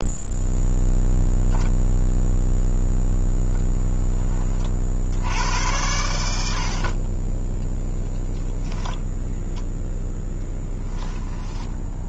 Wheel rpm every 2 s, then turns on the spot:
0, 0, 50, 50, 0, 10.
10-12